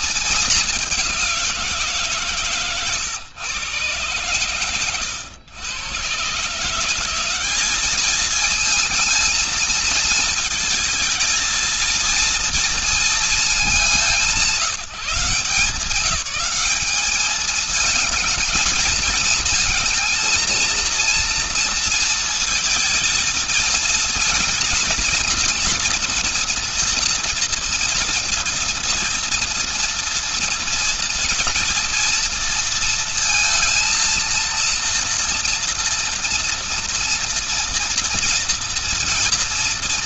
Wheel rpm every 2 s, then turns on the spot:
200, 130, 120, 170, 220, 220, 230, 170, 200, 220, 230, 220, 230, 230, 230, 230, 230, 230, 230, 230.
none